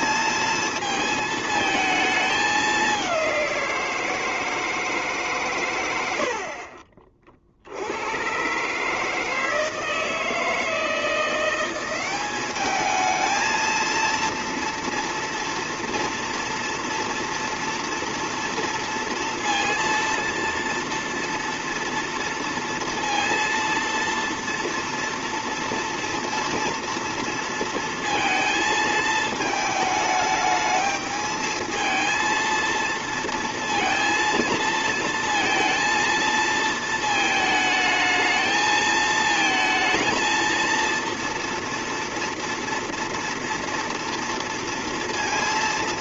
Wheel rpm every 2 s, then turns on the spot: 230, 210, 160, 50, 140, 160, 200, 230, 230, 230, 230, 230, 230, 230, 220, 210, 230, 230, 220, 220, 230, 230, 230.
none